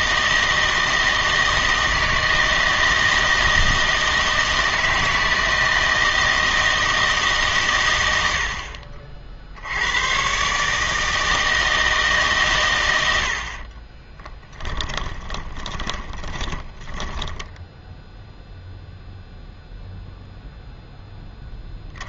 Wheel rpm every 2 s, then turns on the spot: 160, 160, 160, 160, 60, 140, 130, 10, 10, 0, 0.
14-18